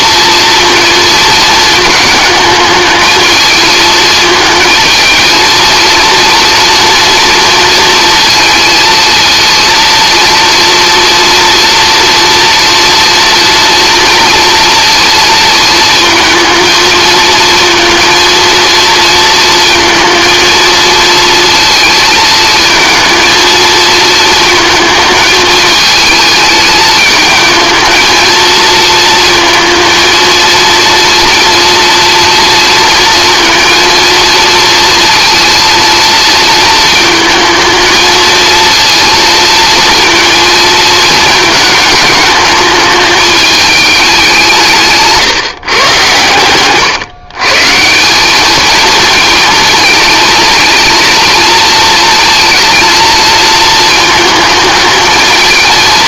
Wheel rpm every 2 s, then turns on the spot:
230, 220, 220, 230, 230, 230, 240, 230, 230, 230, 230, 220, 220, 210, 230, 230, 230, 230, 220, 230, 230, 210, 170, 120, 220, 230, 230, 220.
none